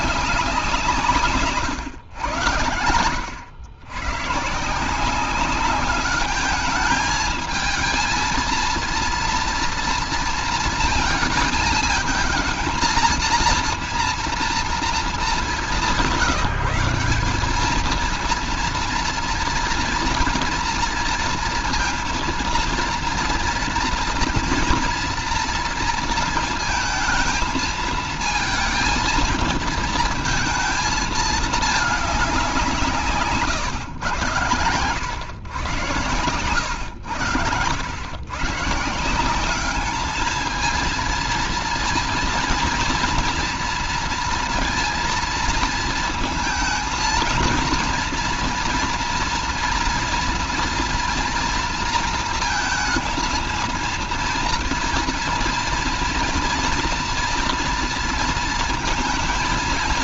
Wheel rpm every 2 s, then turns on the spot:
190, 100, 140, 210, 230, 230, 220, 230, 180, 230, 230, 230, 240, 230, 220, 230, 190, 110, 110, 110, 220, 240, 230, 230, 230, 240, 230, 230, 240, 230.
none